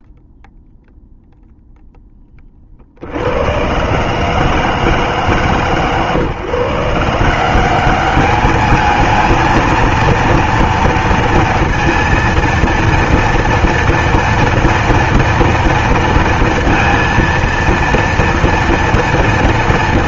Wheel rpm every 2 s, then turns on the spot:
0, 10, 140, 130, 200, 230, 230, 230, 230, 230.
none